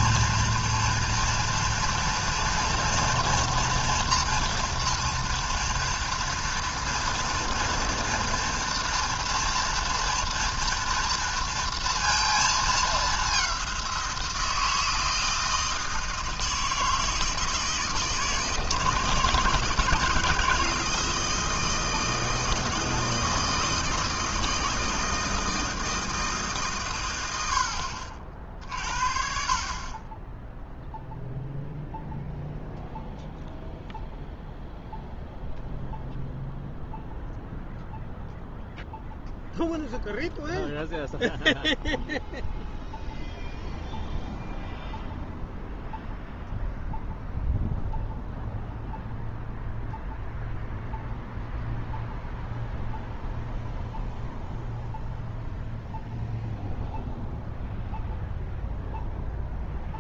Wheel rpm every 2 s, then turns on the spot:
230, 230, 240, 230, 230, 230, 220, 170, 160, 160, 160, 160, 160, 150, 40, 0, 0, 0, 0, 0, 0, 0, 0, 0, 0, 0, 0, 0, 0, 0.
none